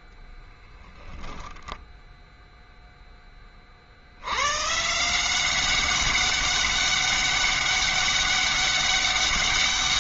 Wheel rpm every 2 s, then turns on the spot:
10, 0, 110, 200, 200.
none